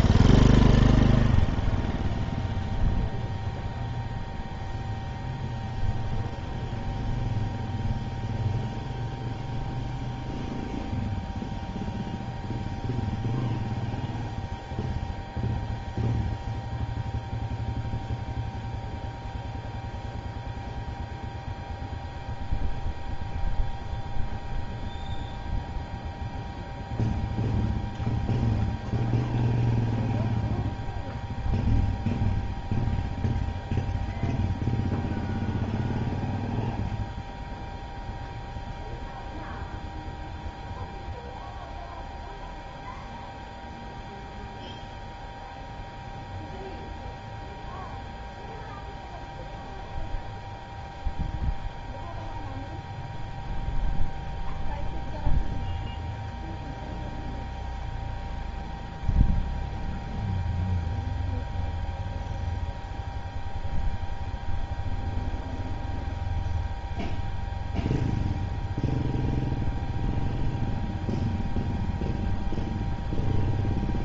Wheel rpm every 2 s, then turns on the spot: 0, 0, 0, 0, 0, 0, 0, 0, 0, 0, 0, 0, 0, 0, 0, 0, 0, 0, 0, 0, 0, 0, 0, 0, 0, 0, 0, 0, 0, 0, 0, 0, 0, 0, 0, 0, 0.
none